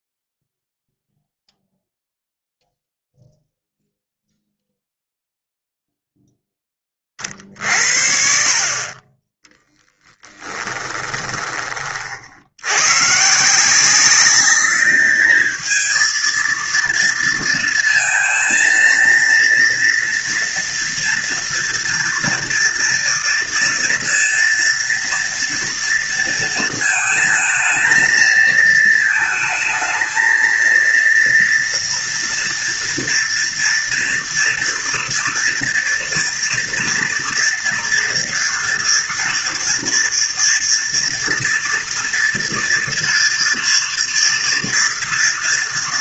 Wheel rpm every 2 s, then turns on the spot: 0, 0, 0, 20, 40, 20, 110, 210, 230, 230, 230, 230, 230, 220, 220, 230, 230, 230, 230, 230, 230, 230, 230.
10-12